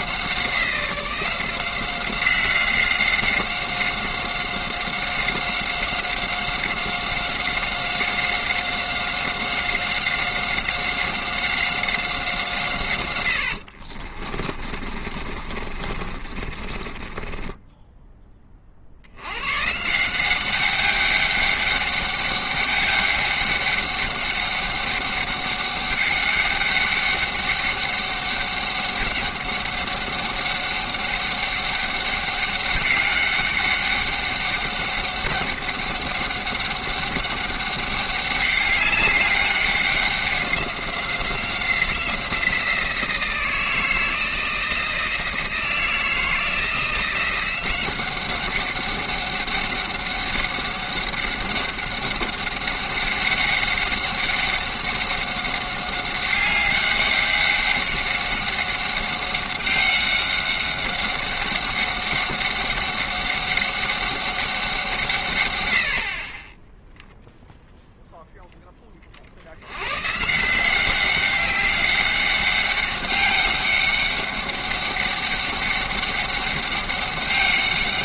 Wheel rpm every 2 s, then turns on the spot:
180, 190, 190, 190, 190, 190, 150, 30, 40, 50, 190, 200, 200, 200, 200, 200, 190, 200, 200, 200, 190, 170, 160, 170, 200, 200, 200, 190, 200, 200, 200, 200, 180, 10, 30, 180, 200, 200, 200.
14-18